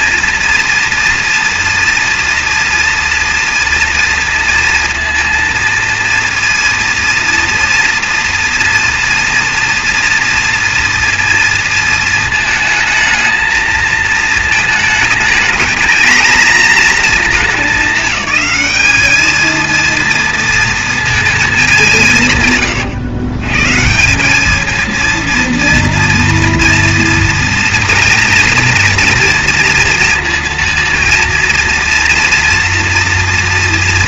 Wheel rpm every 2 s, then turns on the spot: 230, 230, 230, 230, 230, 230, 220, 220, 230, 210, 230, 130, 210, 230, 230, 230, 230.
none